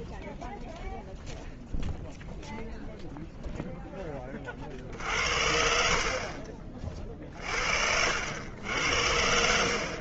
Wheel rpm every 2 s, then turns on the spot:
0, 0, 50, 40, 80.
4-6